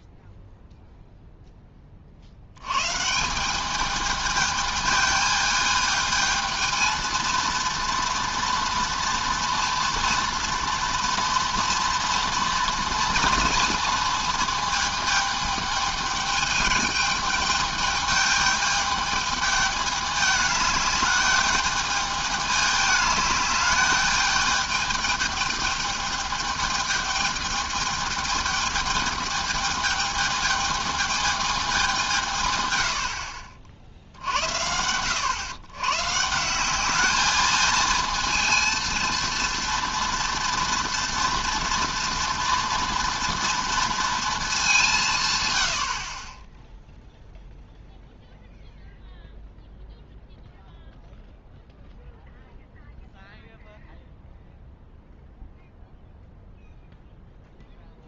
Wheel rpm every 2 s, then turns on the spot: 0, 90, 220, 220, 240, 230, 230, 220, 210, 210, 210, 210, 210, 210, 210, 220, 130, 70, 190, 230, 230, 230, 200, 10, 0, 0, 0, 0, 0.
none